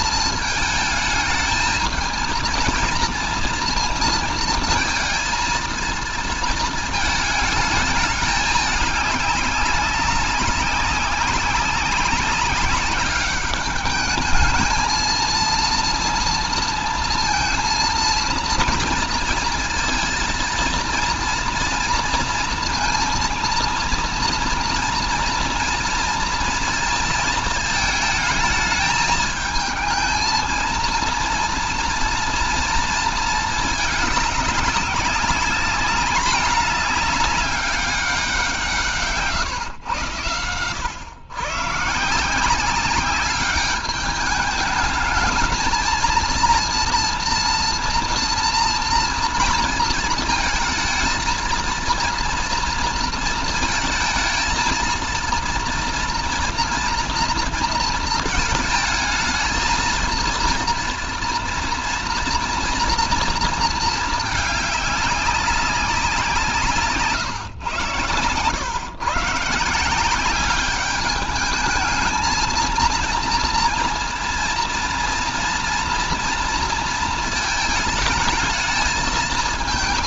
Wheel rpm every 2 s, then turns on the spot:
220, 230, 220, 220, 200, 200, 200, 220, 230, 230, 230, 230, 230, 230, 220, 230, 230, 190, 210, 170, 110, 190, 210, 230, 240, 220, 230, 230, 230, 220, 230, 240, 210, 160, 130, 200, 220, 230, 230, 220.
66-68